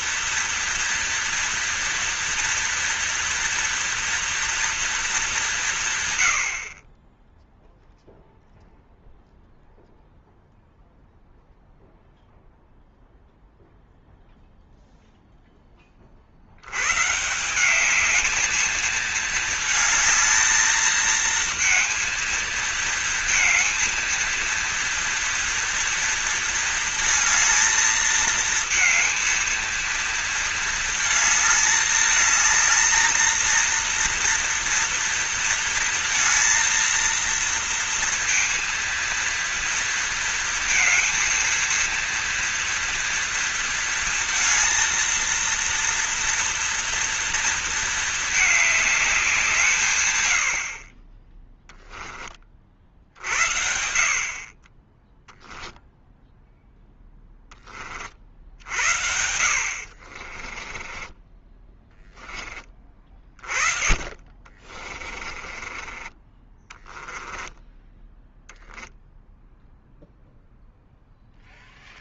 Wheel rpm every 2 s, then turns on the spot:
230, 230, 230, 40, 0, 0, 0, 0, 110, 220, 220, 230, 230, 220, 220, 220, 220, 240, 230, 230, 230, 230, 230, 230, 210, 50, 60, 20, 10, 70, 20, 20, 30, 20, 0, 0.
60-62 64-68